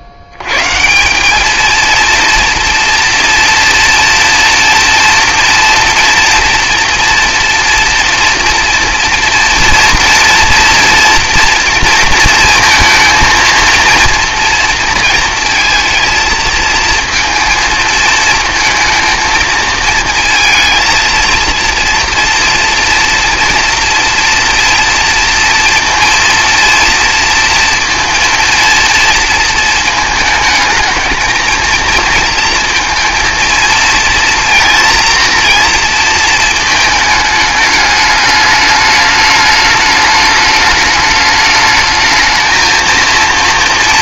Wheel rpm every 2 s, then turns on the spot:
90, 230, 230, 230, 240, 230, 230, 230, 220, 230, 230, 230, 230, 230, 230, 220, 230, 230, 220, 210, 210, 230.
none